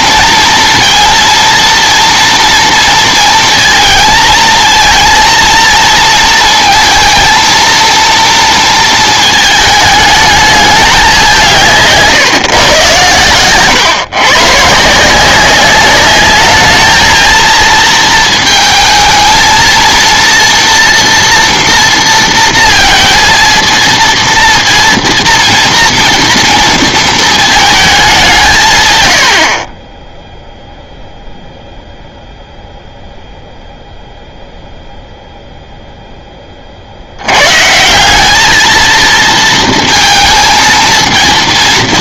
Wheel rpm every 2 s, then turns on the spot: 230, 230, 230, 230, 230, 210, 130, 140, 210, 230, 230, 230, 240, 230, 150, 0, 0, 0, 30, 220, 230.
none